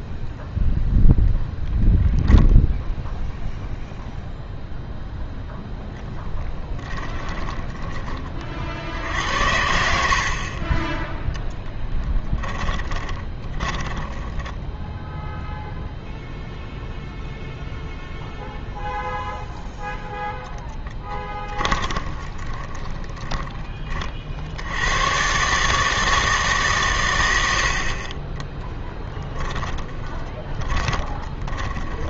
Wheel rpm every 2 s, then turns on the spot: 0, 0, 0, 10, 50, 30, 20, 10, 0, 0, 0, 20, 80, 140, 10, 30.
12-16 22-24 28-32